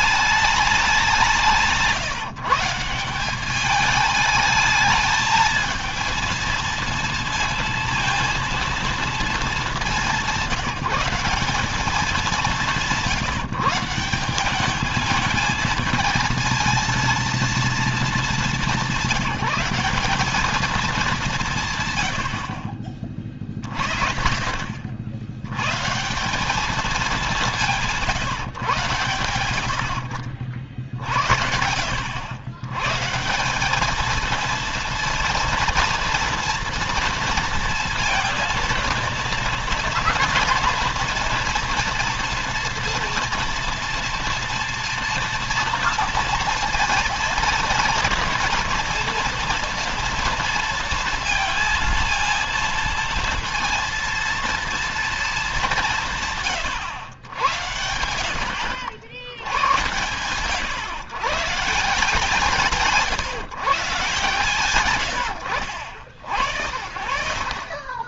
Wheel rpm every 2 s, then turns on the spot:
190, 170, 220, 230, 230, 180, 170, 210, 230, 200, 210, 60, 60, 200, 120, 60, 120, 230, 230, 230, 230, 230, 230, 230, 230, 230, 230, 230, 120, 80, 130, 160, 120, 60.
none